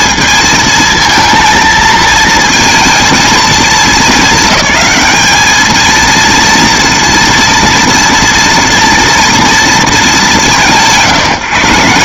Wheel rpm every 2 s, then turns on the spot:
230, 220, 220, 230, 240, 160.
none